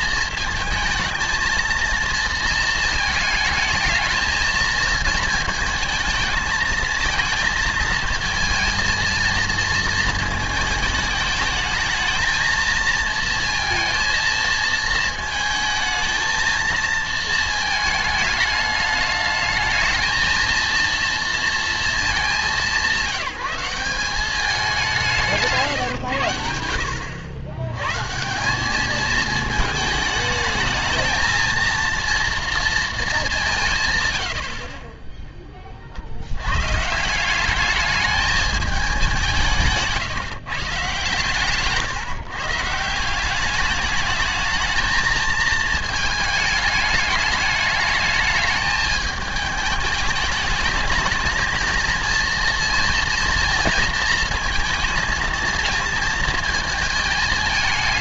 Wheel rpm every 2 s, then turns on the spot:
220, 230, 220, 220, 220, 220, 230, 220, 230, 210, 230, 190, 200, 80, 180, 220, 230, 60, 110, 210, 150, 150, 210, 210, 210, 210, 230, 230, 220.
none